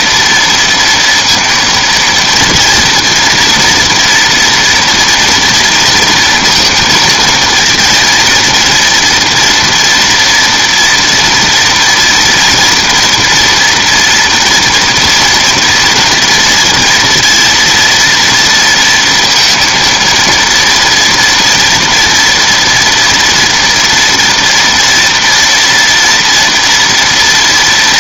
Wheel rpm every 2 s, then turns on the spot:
230, 230, 230, 230, 230, 240, 230, 230, 230, 230, 230, 230, 240, 230.
none